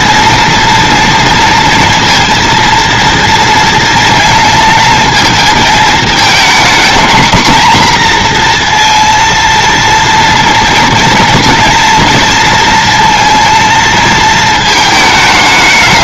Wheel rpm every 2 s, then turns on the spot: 230, 230, 230, 240, 240, 230, 230, 220.
none